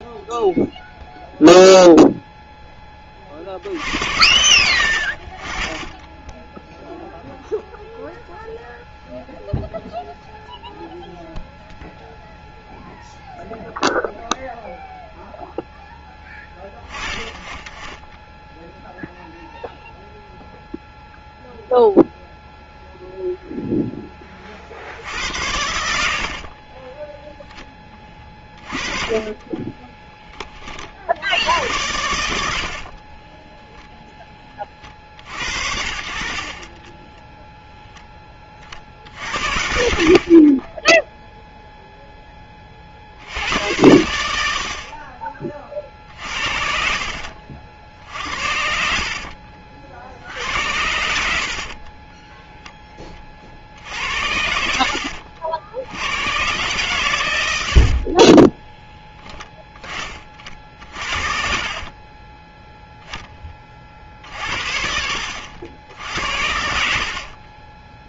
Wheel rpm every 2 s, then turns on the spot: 0, 10, 70, 0, 0, 0, 0, 0, 20, 0, 0, 0, 50, 40, 20, 40, 70, 20, 40, 30, 30, 20, 70, 50, 60, 70, 10, 70, 120, 10, 40, 0, 70, 70.
26-30 40-42 46-48 58-62 66-68